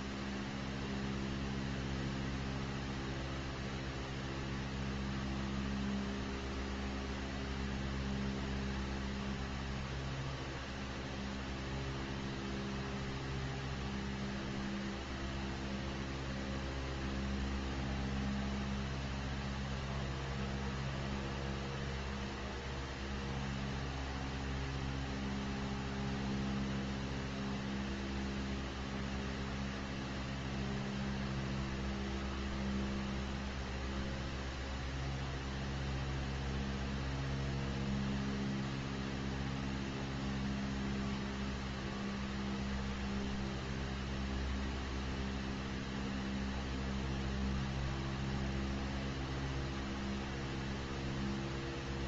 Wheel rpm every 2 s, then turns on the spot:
0, 0, 0, 0, 0, 0, 0, 0, 0, 0, 0, 0, 0, 0, 0, 0, 0, 0, 0, 0, 0, 0, 0, 0, 0, 0.
none